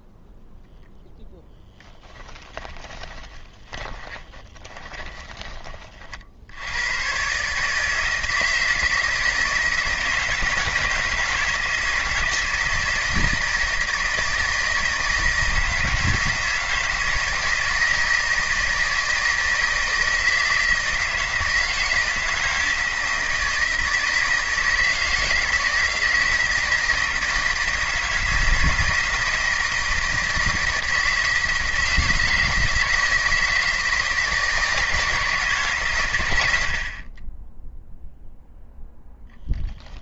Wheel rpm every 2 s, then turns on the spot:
0, 10, 20, 110, 160, 160, 160, 160, 160, 160, 160, 160, 160, 160, 160, 160, 160, 160, 70, 0.
2-6